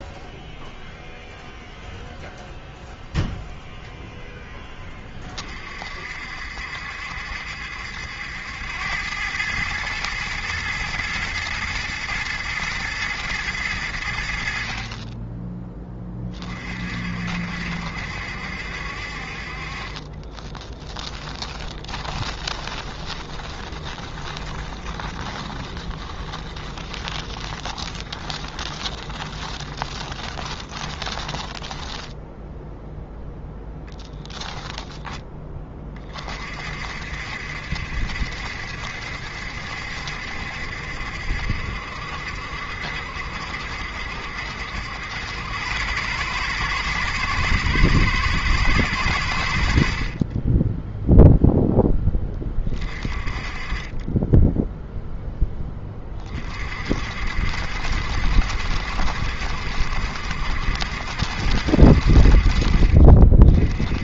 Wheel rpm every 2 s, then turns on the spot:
0, 0, 20, 70, 100, 120, 120, 30, 50, 50, 10, 20, 20, 20, 30, 20, 0, 10, 60, 70, 70, 70, 80, 110, 100, 0, 30, 0, 50, 70, 70, 40.
20-32